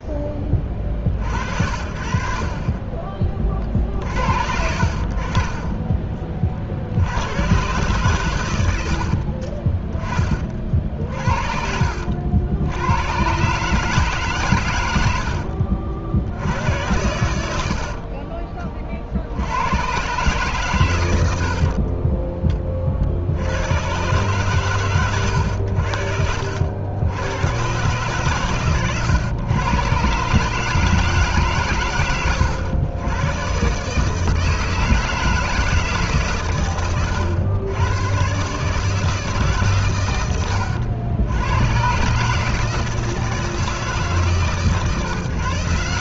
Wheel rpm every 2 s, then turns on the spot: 30, 40, 60, 50, 90, 40, 80, 120, 80, 30, 130, 20, 120, 80, 120, 150, 90, 160, 120, 140, 100, 150, 140.
8-10 16-18